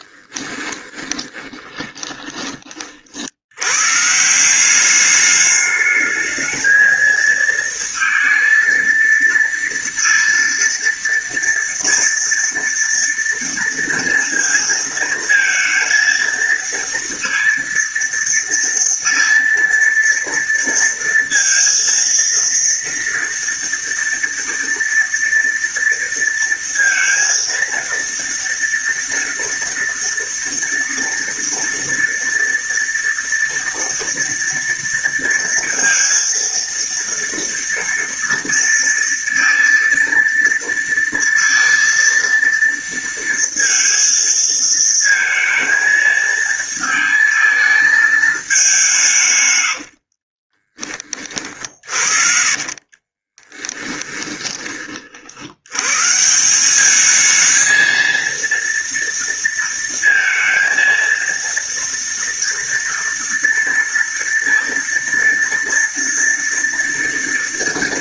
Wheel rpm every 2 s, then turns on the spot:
20, 40, 190, 220, 230, 230, 230, 230, 230, 230, 230, 230, 230, 230, 230, 230, 240, 230, 230, 230, 230, 230, 220, 220, 170, 40, 40, 30, 200, 230, 230, 230, 230, 230.
0-2 52-54